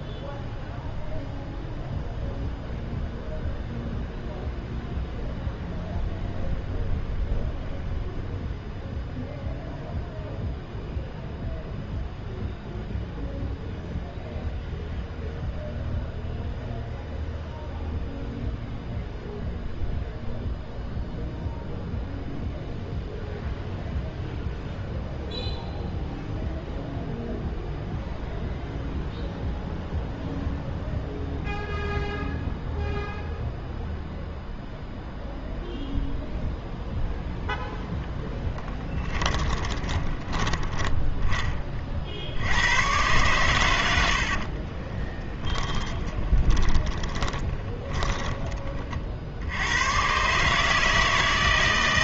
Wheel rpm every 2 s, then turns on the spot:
0, 0, 0, 0, 0, 0, 0, 0, 0, 0, 0, 0, 0, 0, 0, 0, 0, 0, 0, 10, 20, 90, 30, 20, 30, 150.
38-42 44-48